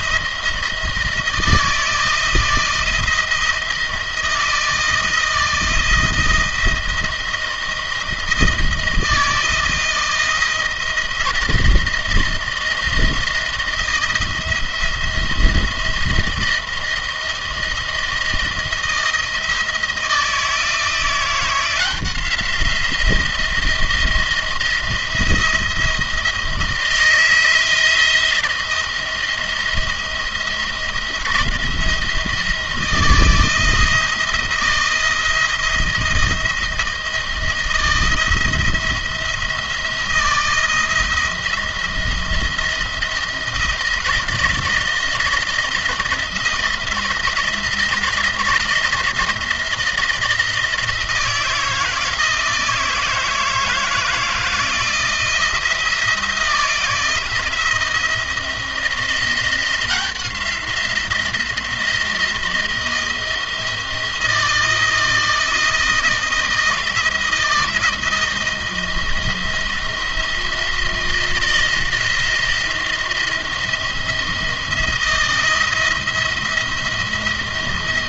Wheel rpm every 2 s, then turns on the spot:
160, 160, 160, 170, 160, 160, 160, 170, 170, 170, 160, 170, 170, 160, 170, 170, 170, 170, 160, 170, 160, 160, 170, 170, 170, 170, 170, 170, 170, 170, 170, 160, 160, 170, 160, 170, 170, 170, 170.
none